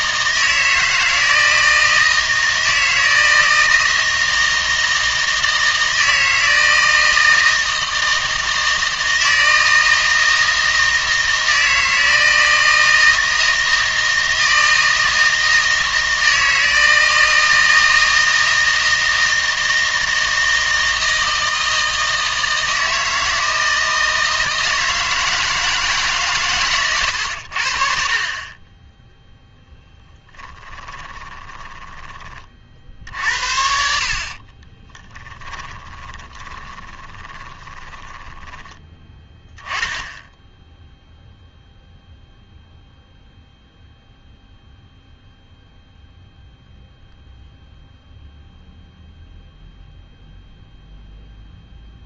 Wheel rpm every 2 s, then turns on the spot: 160, 160, 160, 160, 160, 160, 160, 160, 160, 160, 160, 160, 160, 120, 20, 30, 50, 30, 20, 10, 0, 0, 0, 0, 0, 0.
30-32 34-38